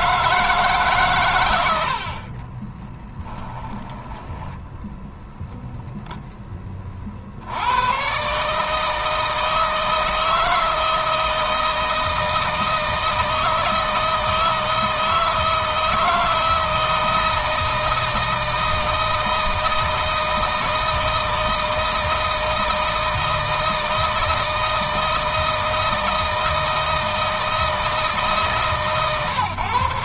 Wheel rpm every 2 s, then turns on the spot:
150, 30, 10, 30, 150, 160, 160, 160, 160, 160, 160, 160, 160, 160, 140.
2-6